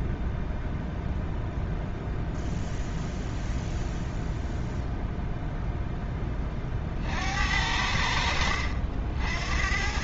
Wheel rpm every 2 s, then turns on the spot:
0, 0, 0, 20, 70.
none